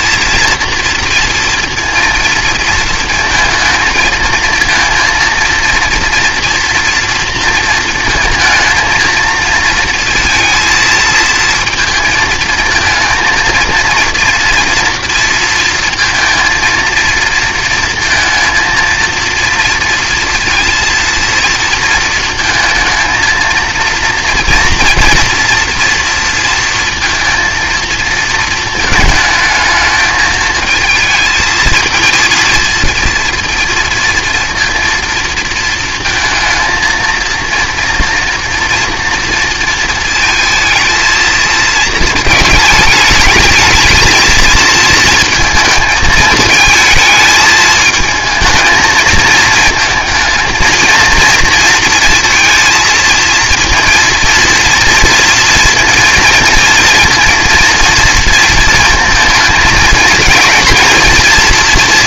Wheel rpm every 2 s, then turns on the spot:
230, 230, 220, 230, 230, 230, 220, 230, 230, 230, 230, 230, 230, 230, 220, 220, 230, 230, 230, 230, 220, 220, 220, 220, 220, 230, 230, 230, 230, 230, 230.
none